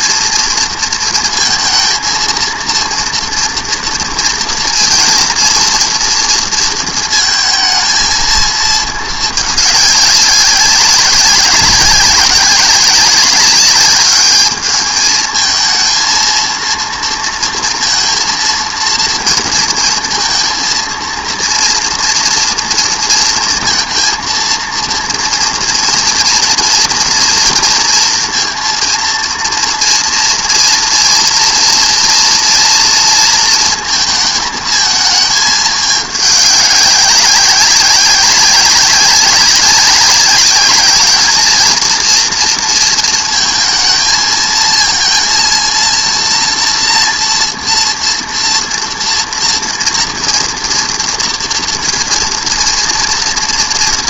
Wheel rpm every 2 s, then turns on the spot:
230, 230, 230, 230, 220, 190, 190, 210, 230, 230, 230, 230, 230, 230, 230, 230, 230, 220, 200, 190, 200, 230, 220, 230, 230, 240, 230.
none